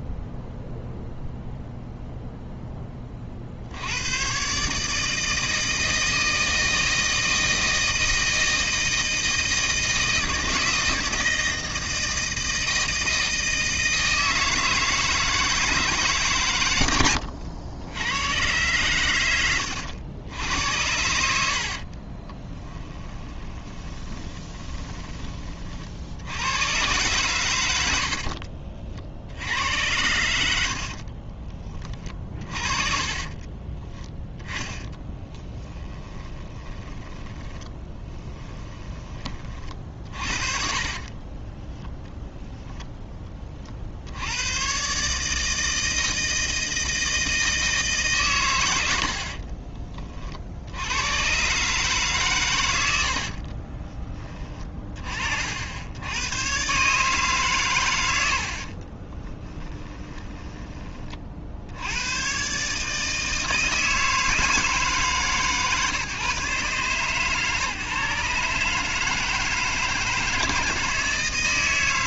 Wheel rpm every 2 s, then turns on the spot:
0, 10, 140, 160, 160, 160, 160, 160, 110, 120, 80, 20, 20, 110, 50, 60, 40, 10, 20, 20, 50, 0, 120, 160, 100, 80, 100, 30, 130, 50, 20, 140, 150, 130, 150, 160.
22-26 30-42 58-60